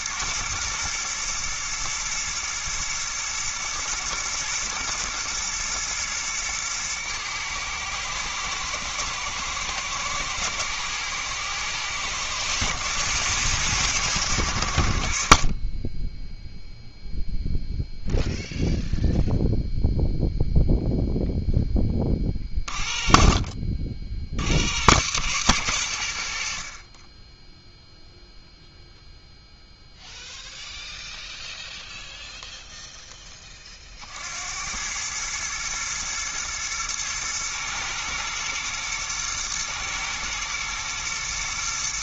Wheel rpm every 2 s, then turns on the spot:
120, 120, 110, 110, 110, 120, 110, 90, 0, 0, 0, 30, 90, 50, 0, 0, 0, 90, 110, 110, 120.
none